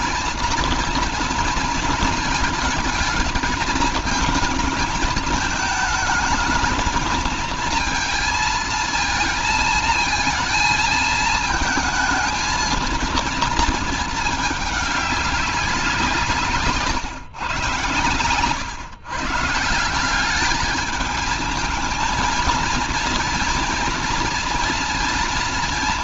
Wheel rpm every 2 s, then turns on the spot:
230, 220, 220, 220, 230, 220, 220, 210, 150, 130, 210, 230, 240.
none